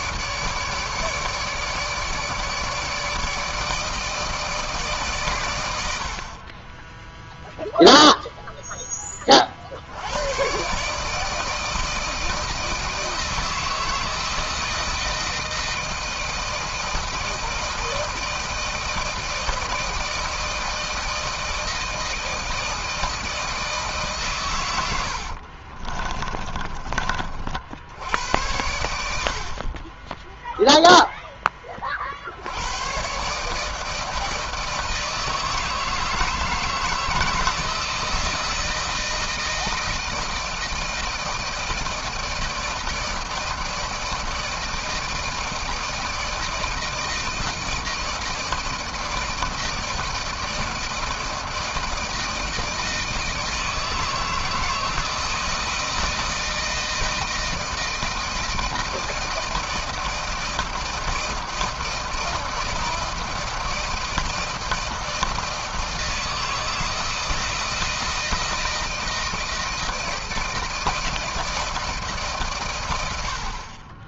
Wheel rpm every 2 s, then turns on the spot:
150, 160, 140, 10, 10, 140, 160, 160, 160, 160, 160, 160, 90, 30, 80, 0, 110, 160, 160, 160, 160, 160, 160, 160, 160, 160, 160, 170, 160, 170, 160, 160, 160, 160, 160, 160, 90.
24-26